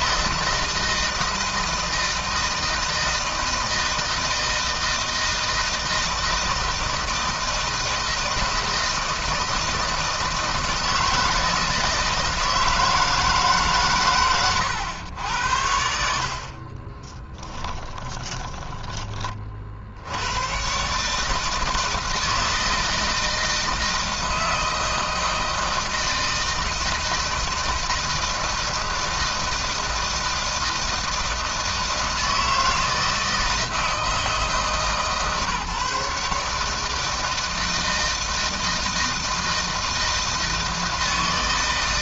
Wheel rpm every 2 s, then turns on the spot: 160, 160, 160, 160, 160, 160, 160, 90, 20, 20, 140, 160, 160, 160, 160, 160, 160, 150, 160, 160, 160.
16-18